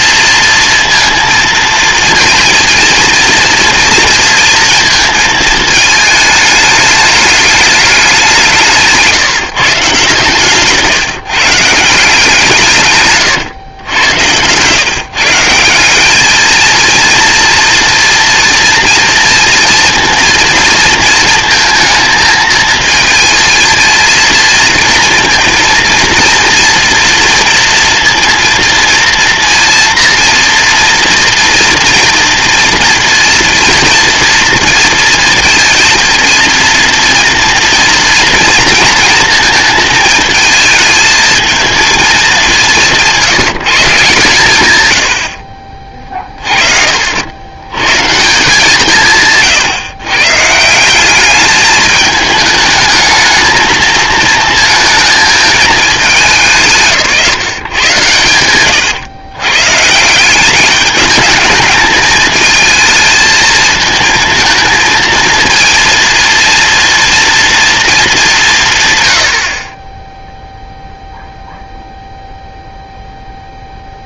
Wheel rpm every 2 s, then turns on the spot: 230, 230, 220, 210, 160, 150, 140, 160, 230, 230, 230, 230, 230, 230, 230, 230, 230, 230, 230, 230, 220, 170, 80, 50, 160, 190, 220, 230, 150, 110, 200, 220, 230, 240, 100, 0, 0.
none